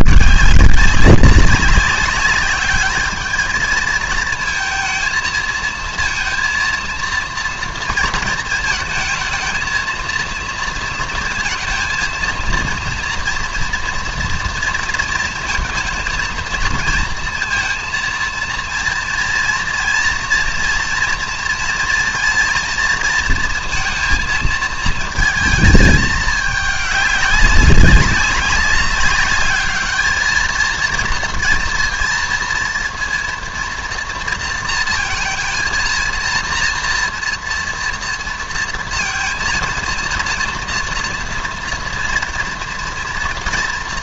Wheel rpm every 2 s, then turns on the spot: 180, 210, 230, 230, 220, 230, 230, 230, 230, 230, 230, 230, 230, 210, 190, 230, 230, 230, 230, 230, 240, 230.
none